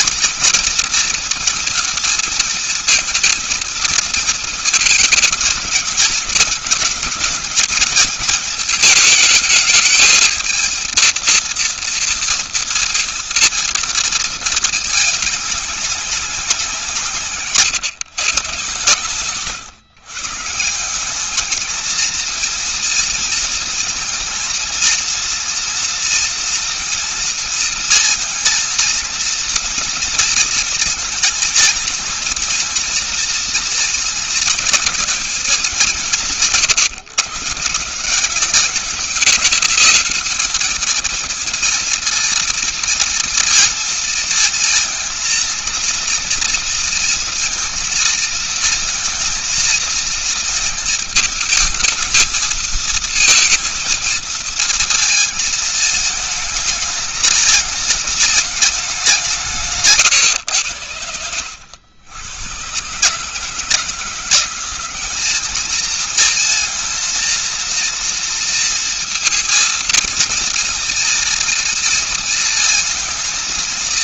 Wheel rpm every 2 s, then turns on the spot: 240, 220, 220, 210, 220, 220, 230, 220, 180, 130, 160, 230, 230, 230, 230, 230, 230, 230, 160, 190, 210, 230, 230, 230, 230, 220, 220, 230, 220, 210, 100, 110, 180, 230, 230, 230, 230.
none